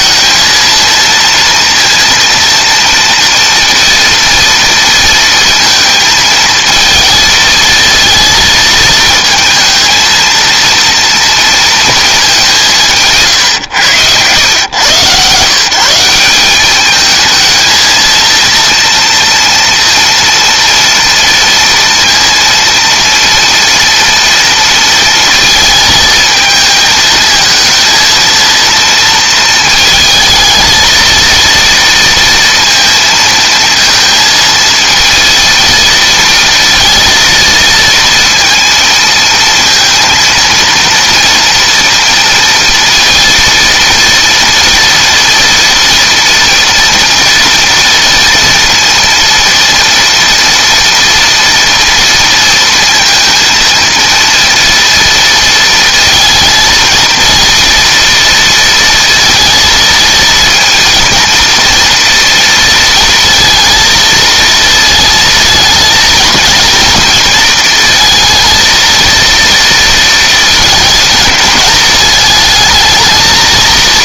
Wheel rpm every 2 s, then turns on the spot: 230, 230, 230, 220, 230, 230, 200, 110, 190, 230, 230, 230, 230, 220, 230, 220, 230, 230, 230, 230, 230, 230, 230, 230, 230, 230, 230, 230, 220, 230, 230, 230, 230, 230, 230, 230, 220.
none